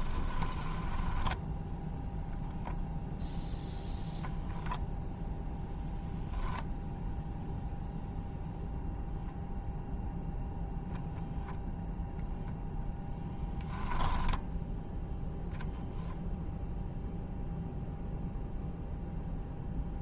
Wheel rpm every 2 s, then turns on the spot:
10, 0, 0, 0, 0, 0, 0, 0, 0, 0.
0-2